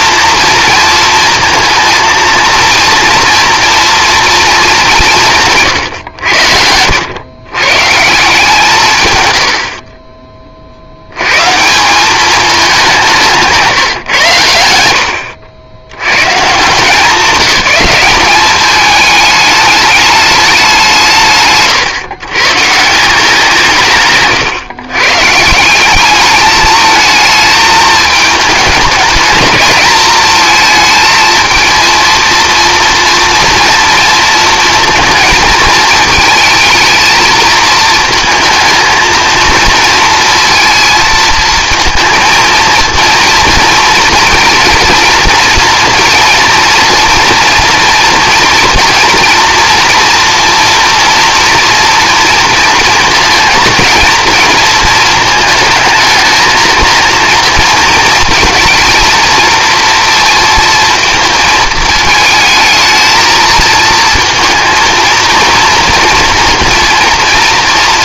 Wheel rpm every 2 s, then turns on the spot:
230, 230, 210, 80, 160, 60, 200, 100, 160, 200, 200, 150, 130, 220, 220, 220, 230, 230, 220, 230, 230, 230, 230, 230, 230, 230, 230, 220, 220, 230, 230, 220, 230, 230.
6-8